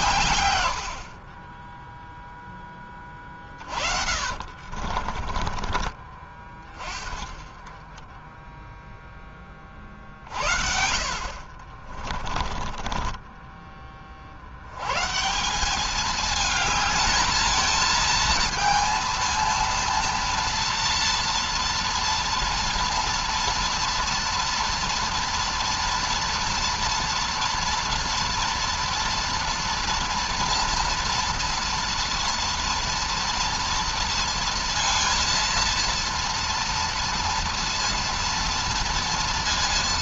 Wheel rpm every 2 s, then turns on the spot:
90, 30, 50, 30, 0, 80, 20, 120, 220, 230, 230, 230, 230, 230, 230, 230, 240, 230, 230, 230.
2-6 12-14